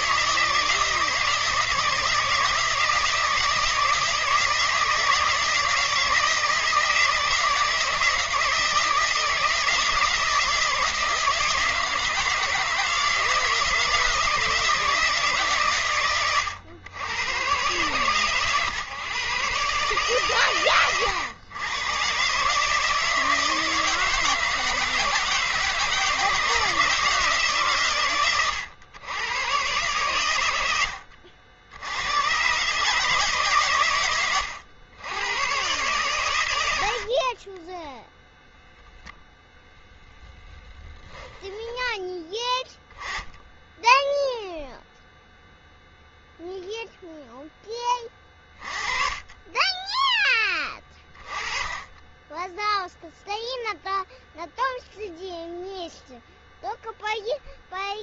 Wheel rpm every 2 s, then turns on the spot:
160, 160, 160, 160, 160, 160, 160, 160, 110, 120, 120, 150, 160, 160, 110, 90, 140, 100, 70, 0, 10, 10, 0, 0, 30, 20, 0, 0, 0.
none